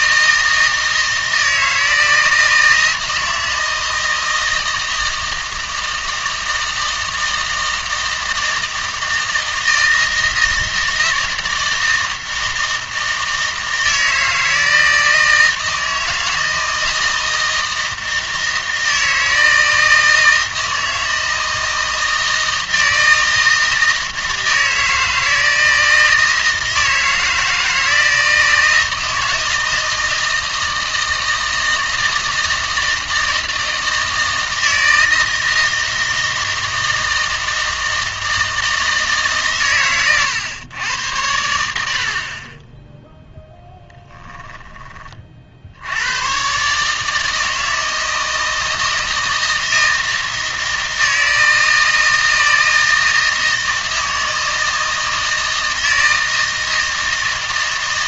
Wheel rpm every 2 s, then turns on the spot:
160, 160, 160, 160, 160, 160, 160, 160, 160, 160, 160, 160, 160, 160, 160, 160, 160, 160, 160, 160, 110, 10, 20, 140, 160, 160, 160, 160, 160.
none